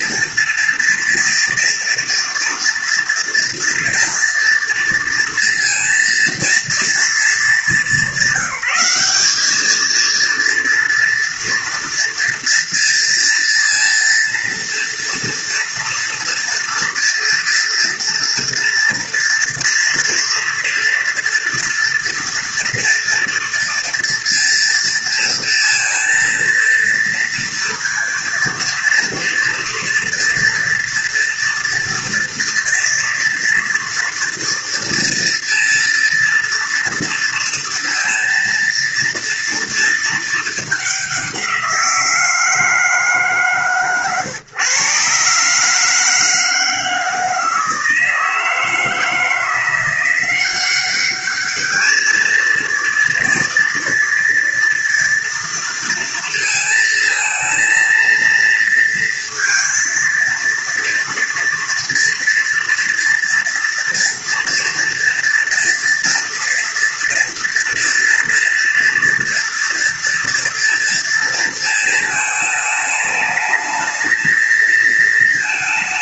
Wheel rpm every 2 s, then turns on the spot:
230, 230, 230, 220, 200, 230, 230, 230, 230, 230, 230, 230, 230, 230, 230, 240, 230, 230, 240, 230, 200, 160, 130, 160, 160, 200, 230, 230, 230, 230, 230, 230, 230, 230, 230, 230, 210, 220.
none